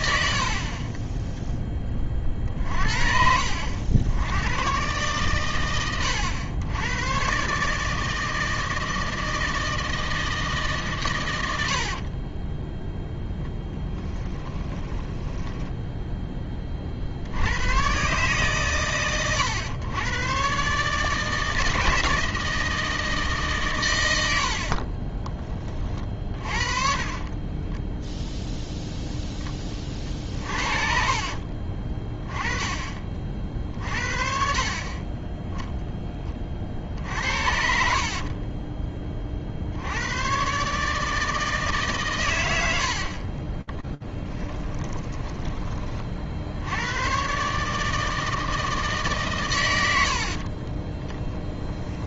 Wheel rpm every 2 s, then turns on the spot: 30, 50, 120, 100, 160, 140, 10, 10, 50, 130, 150, 160, 30, 30, 0, 40, 40, 30, 50, 20, 140, 80, 10, 100, 150, 30.
0-2 12-16 24-28 30-32 44-46 50-52